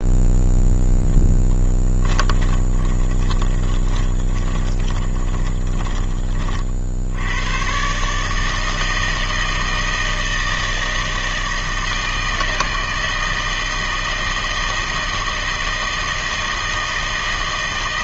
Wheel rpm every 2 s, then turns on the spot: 0, 20, 20, 50, 160, 160, 160, 160, 160.
2-6